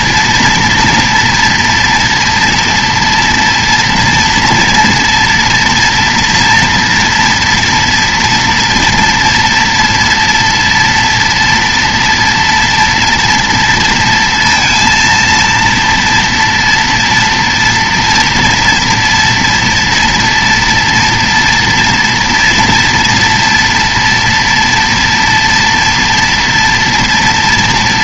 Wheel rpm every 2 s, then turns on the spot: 230, 230, 230, 230, 230, 230, 230, 230, 230, 230, 230, 230, 230, 230.
none